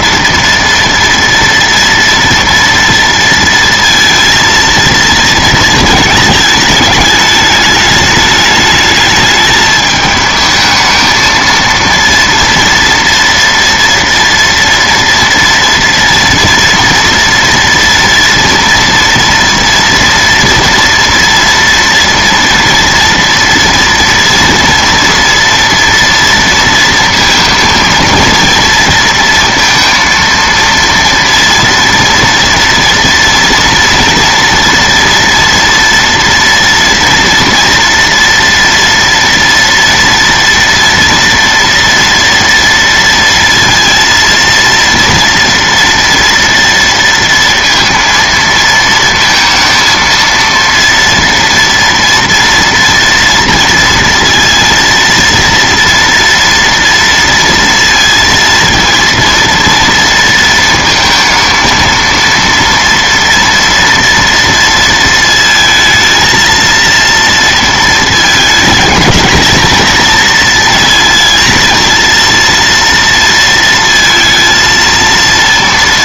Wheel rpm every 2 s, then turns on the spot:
230, 230, 230, 210, 210, 220, 230, 230, 230, 230, 230, 240, 240, 230, 230, 230, 230, 230, 230, 230, 230, 230, 230, 230, 230, 230, 230, 230, 230, 230, 220, 240, 230, 230, 230, 230, 230, 230.
none